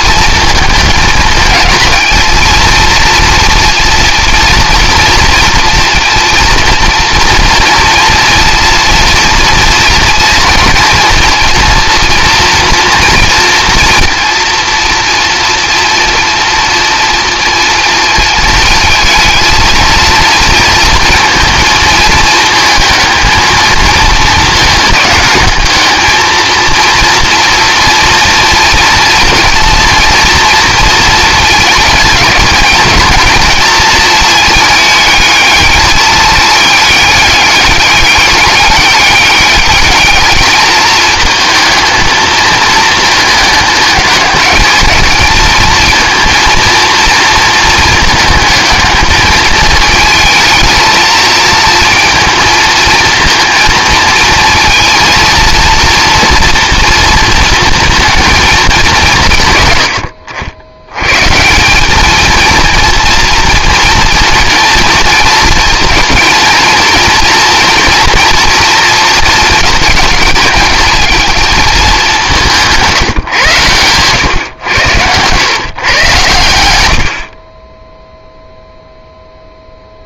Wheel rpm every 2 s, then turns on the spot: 220, 230, 230, 230, 230, 230, 240, 230, 230, 220, 230, 220, 210, 230, 230, 230, 220, 220, 210, 200, 220, 220, 220, 230, 220, 230, 230, 230, 230, 190, 90, 230, 230, 230, 230, 220, 170, 110, 90, 0.
72-76